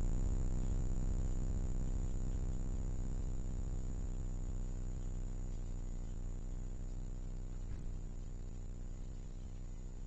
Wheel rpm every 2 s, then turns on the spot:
0, 0, 0, 0, 0.
none